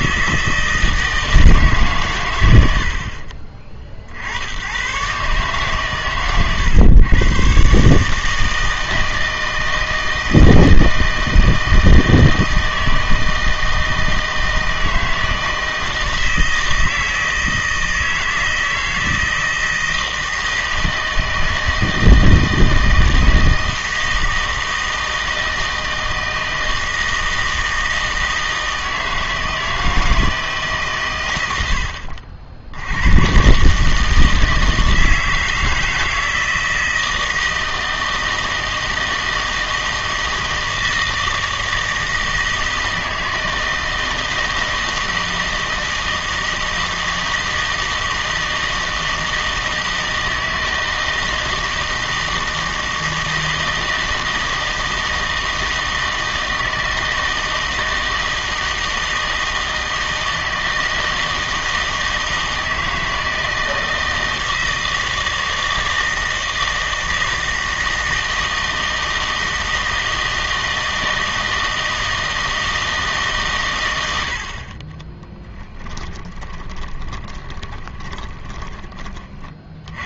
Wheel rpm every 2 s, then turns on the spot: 160, 90, 90, 120, 160, 160, 160, 160, 160, 160, 160, 160, 160, 160, 160, 150, 80, 160, 160, 160, 160, 160, 160, 160, 160, 160, 160, 160, 160, 160, 160, 160, 160, 160, 160, 160, 160, 50, 20, 10.
76-80